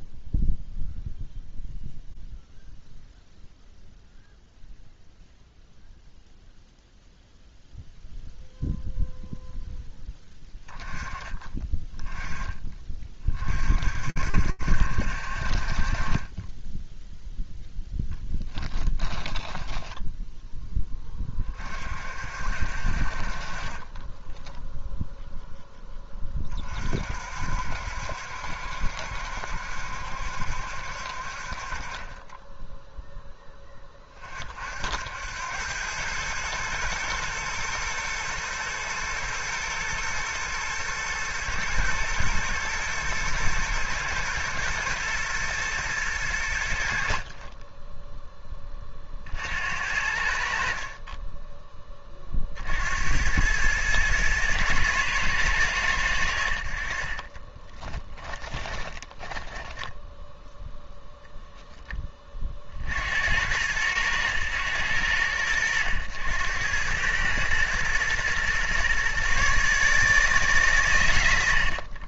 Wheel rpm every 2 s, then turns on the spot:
0, 0, 0, 0, 0, 10, 30, 60, 0, 10, 20, 50, 0, 50, 70, 60, 0, 80, 120, 110, 110, 110, 120, 50, 50, 30, 80, 110, 40, 10, 0, 60, 80, 100, 130, 110.
18-20 56-60